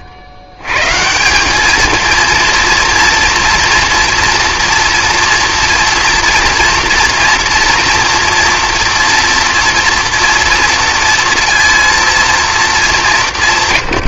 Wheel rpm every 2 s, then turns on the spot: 110, 230, 240, 240, 240, 230, 220.
none